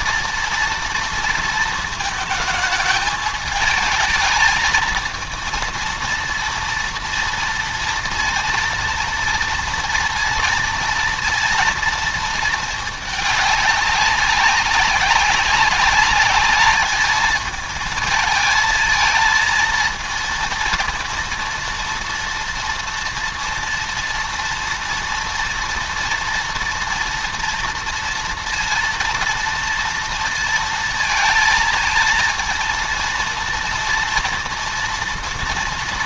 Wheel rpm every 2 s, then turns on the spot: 230, 220, 220, 230, 230, 230, 220, 190, 210, 220, 230, 230, 230, 230, 230, 230, 230, 230.
none